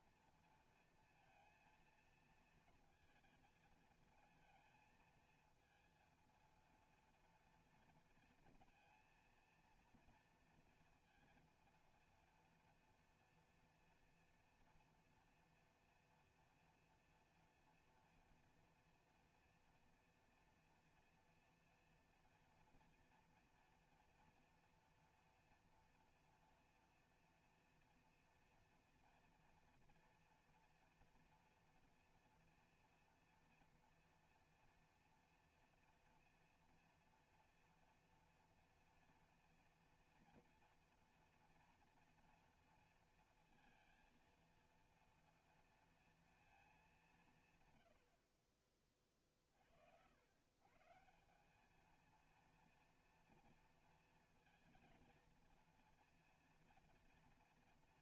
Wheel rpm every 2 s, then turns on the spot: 230, 230, 220, 230, 230, 230, 230, 230, 240, 230, 230, 230, 230, 240, 240, 240, 240, 230, 230, 240, 240, 230, 230, 230, 60, 100, 230, 230, 230.
48-50